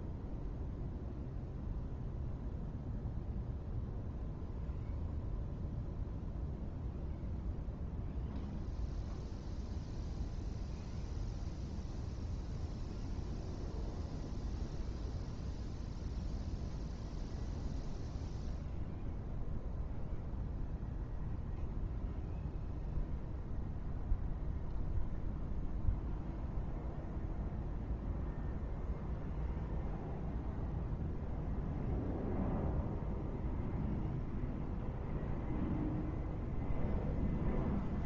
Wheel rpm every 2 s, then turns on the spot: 0, 0, 0, 0, 0, 0, 0, 0, 0, 0, 0, 0, 0, 0, 0, 0, 0, 0, 0.
none